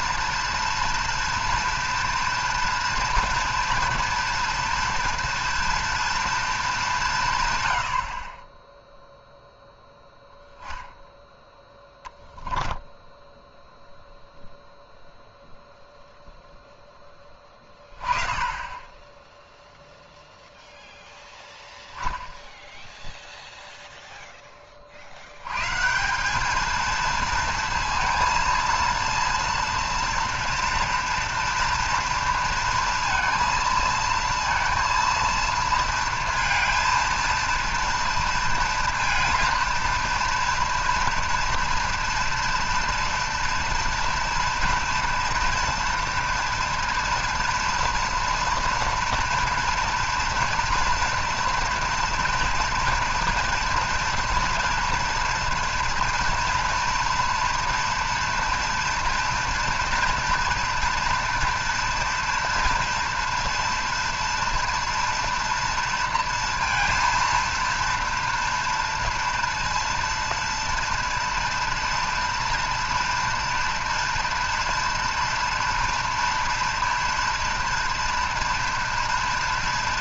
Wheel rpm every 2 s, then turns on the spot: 230, 230, 230, 210, 10, 10, 10, 0, 0, 10, 0, 10, 20, 210, 230, 230, 230, 230, 230, 230, 230, 240, 240, 230, 230, 230, 230, 240, 240, 240, 230, 230, 230, 230, 230, 230, 230, 230, 230, 230.
12-14